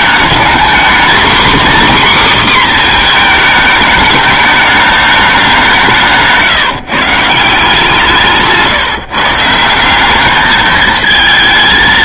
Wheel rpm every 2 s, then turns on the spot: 220, 270, 210, 160, 160, 200.
6-8